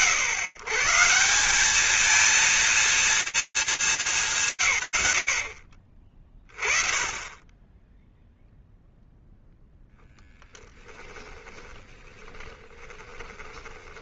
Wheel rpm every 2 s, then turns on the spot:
140, 230, 120, 20, 0, 10, 20.
10-14